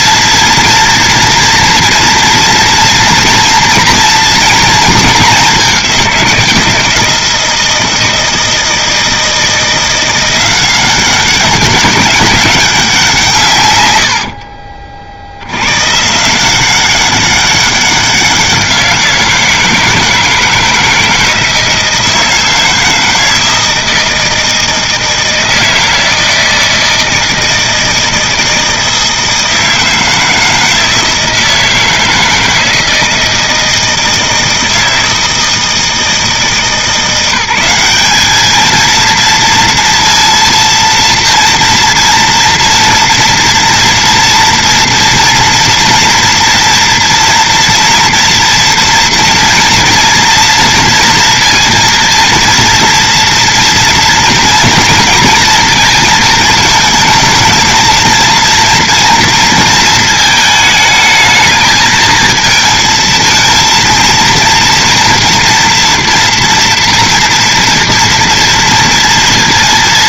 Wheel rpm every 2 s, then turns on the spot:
230, 230, 220, 170, 160, 180, 200, 50, 180, 180, 160, 160, 160, 160, 160, 160, 160, 160, 160, 220, 230, 230, 230, 230, 230, 230, 230, 230, 230, 230, 220, 220, 240, 230, 230.
14-16